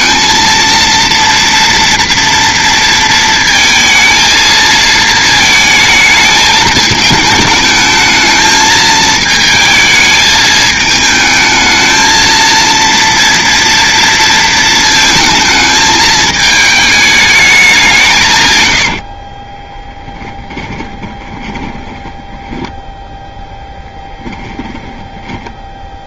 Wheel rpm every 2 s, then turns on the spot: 230, 230, 220, 220, 220, 220, 230, 220, 220, 100, 20, 10, 20.
18-26